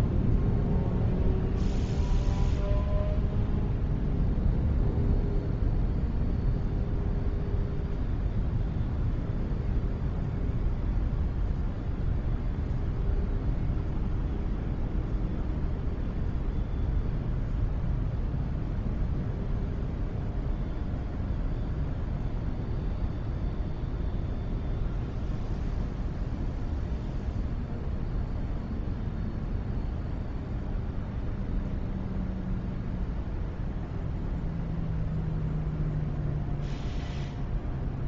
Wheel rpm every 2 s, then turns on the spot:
0, 0, 0, 0, 0, 0, 0, 0, 0, 0, 0, 0, 0, 0, 0, 0, 0, 0, 0.
none